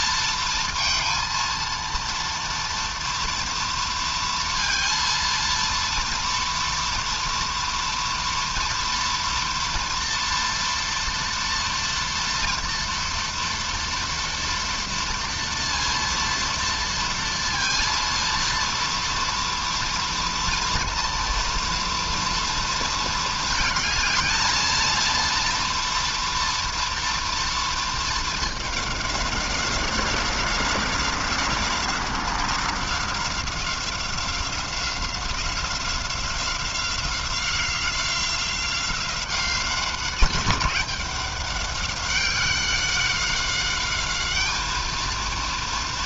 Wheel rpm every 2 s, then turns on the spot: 230, 230, 230, 230, 240, 230, 230, 230, 230, 230, 230, 230, 230, 240, 210, 190, 190, 180, 180, 180, 190, 190, 210.
none